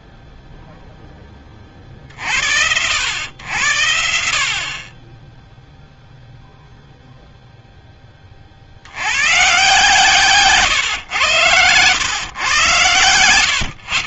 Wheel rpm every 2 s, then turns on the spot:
0, 30, 80, 0, 40, 130, 110.
none